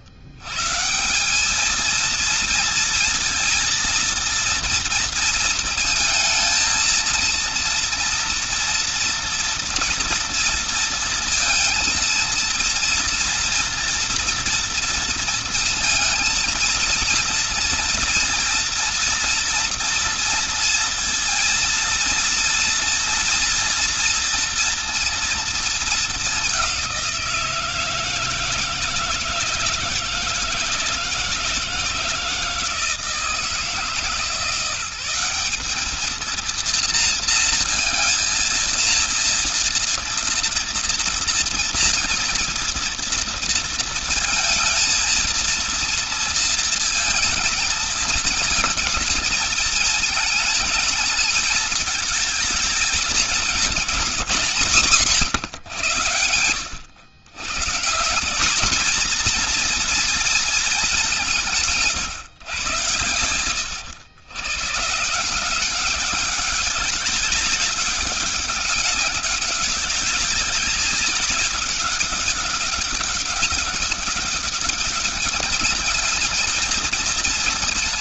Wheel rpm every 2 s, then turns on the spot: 130, 230, 230, 220, 230, 230, 230, 230, 230, 240, 230, 230, 230, 200, 160, 160, 160, 170, 230, 230, 230, 230, 230, 220, 220, 220, 220, 180, 110, 190, 230, 120, 130, 200, 200, 200, 190, 190, 220.
54-56